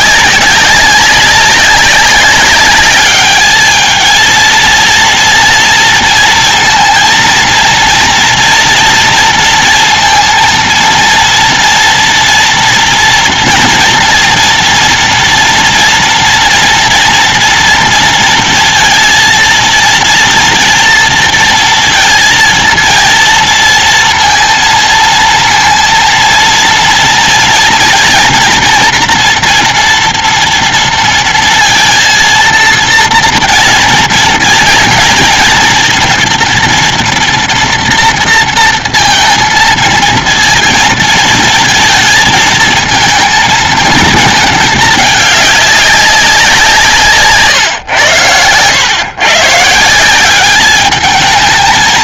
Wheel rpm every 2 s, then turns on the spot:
200, 190, 220, 230, 230, 230, 230, 240, 230, 230, 230, 230, 230, 230, 230, 230, 230, 230, 230, 230, 230, 220, 220, 190, 110, 180.
none